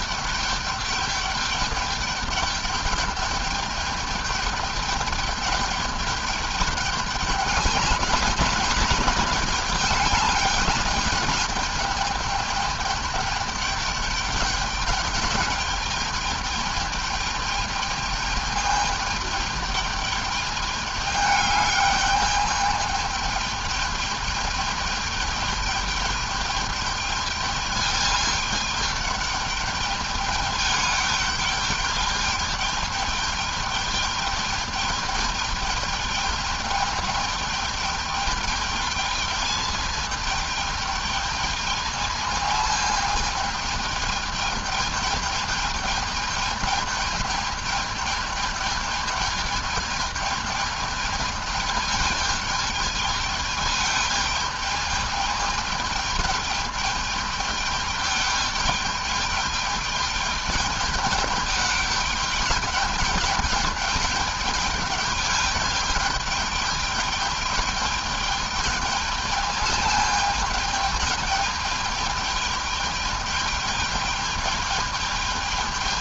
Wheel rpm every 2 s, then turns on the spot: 210, 200, 210, 200, 210, 200, 210, 210, 210, 210, 210, 210, 210, 210, 210, 210, 210, 210, 210, 210, 210, 220, 210, 220, 210, 210, 210, 210, 210, 210, 210, 210, 210, 210, 210, 210, 210, 210.
none